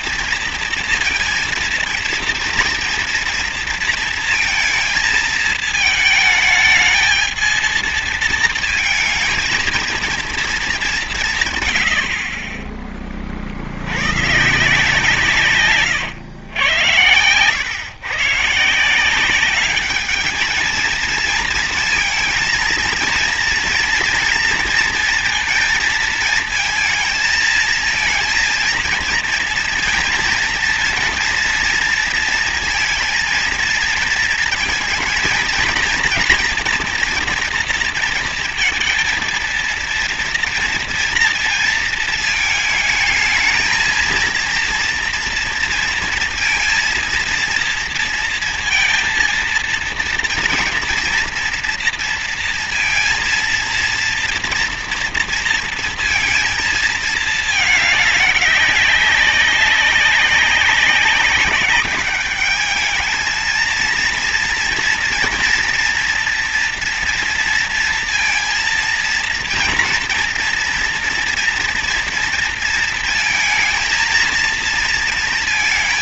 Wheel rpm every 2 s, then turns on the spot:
230, 230, 230, 220, 230, 200, 30, 160, 110, 160, 220, 230, 230, 230, 230, 240, 230, 220, 240, 230, 240, 220, 230, 230, 230, 230, 230, 230, 220, 200, 200, 210, 230, 240, 230, 230, 230, 230.
none